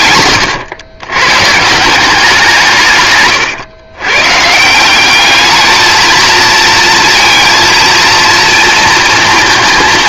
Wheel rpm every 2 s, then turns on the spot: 120, 160, 160, 230, 230.
none